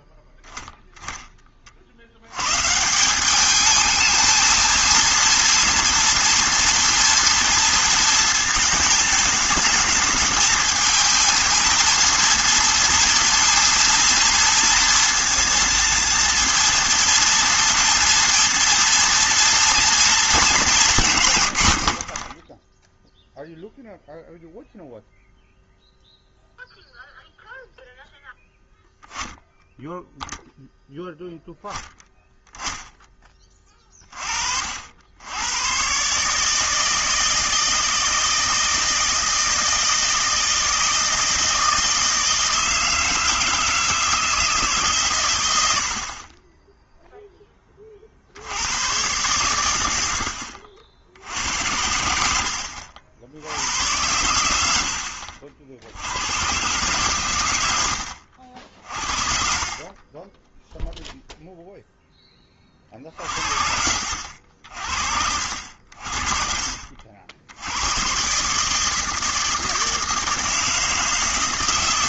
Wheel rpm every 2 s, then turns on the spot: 10, 130, 220, 230, 220, 220, 230, 230, 230, 230, 210, 10, 0, 0, 0, 0, 0, 50, 150, 160, 160, 160, 160, 20, 80, 60, 70, 90, 120, 70, 10, 30, 60, 50, 150, 160.
none